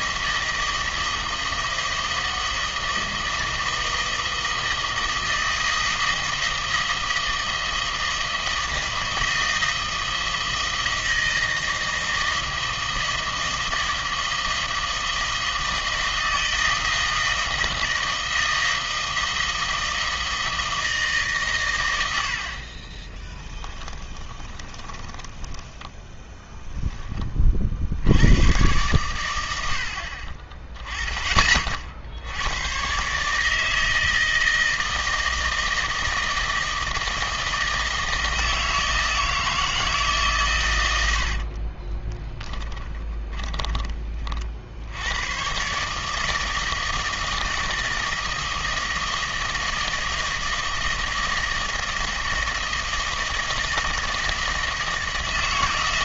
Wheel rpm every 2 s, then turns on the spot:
160, 160, 160, 160, 160, 160, 160, 160, 160, 160, 160, 40, 20, 10, 110, 20, 100, 160, 160, 160, 110, 20, 70, 160, 160, 160, 160, 160.
24-28 42-44